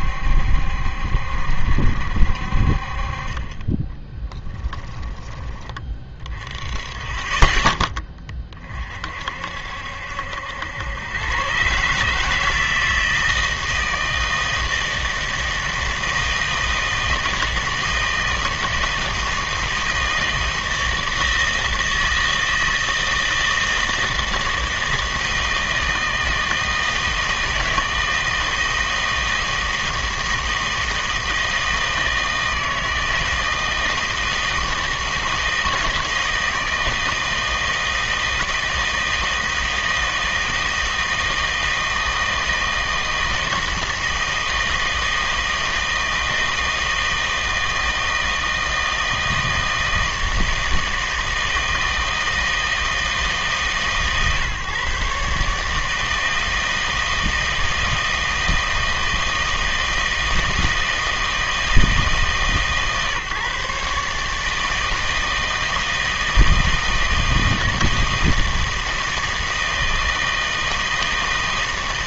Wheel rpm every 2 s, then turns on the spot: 70, 50, 10, 20, 40, 90, 160, 160, 160, 160, 160, 160, 160, 160, 160, 160, 160, 160, 160, 160, 160, 160, 160, 160, 160, 160, 160, 130, 160, 160, 160, 150, 160, 160, 160, 160.
4-6